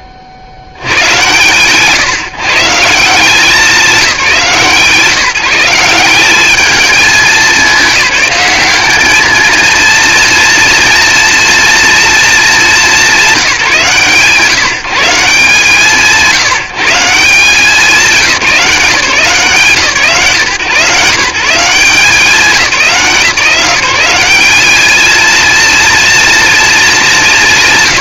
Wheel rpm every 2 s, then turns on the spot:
30, 150, 170, 220, 200, 230, 210, 150, 160, 170, 160, 180, 210, 210.
none